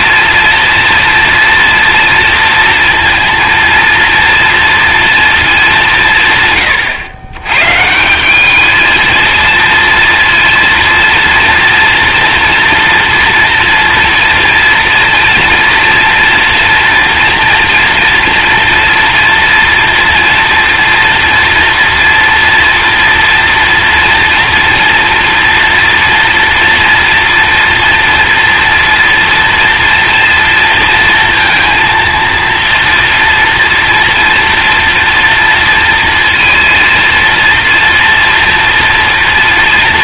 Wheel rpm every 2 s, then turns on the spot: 230, 230, 230, 120, 220, 230, 240, 230, 230, 230, 230, 230, 230, 230, 240, 230, 230, 230, 230, 230.
none